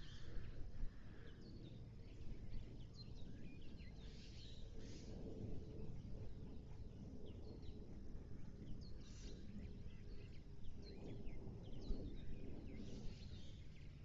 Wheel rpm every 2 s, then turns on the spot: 0, 0, 0, 0, 0, 0, 0.
none